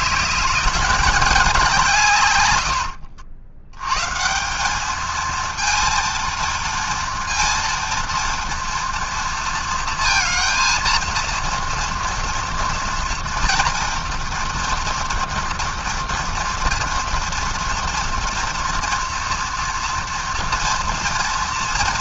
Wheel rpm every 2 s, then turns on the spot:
210, 100, 190, 230, 230, 230, 230, 230, 230, 240, 230.
2-4